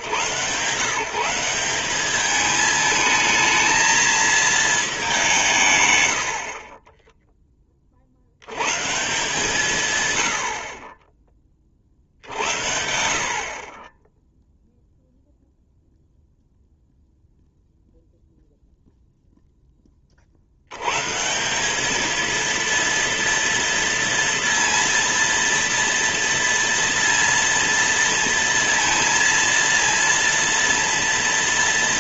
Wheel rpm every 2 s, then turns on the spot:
140, 220, 220, 30, 110, 50, 70, 0, 0, 0, 80, 230, 230, 230, 230, 230.
none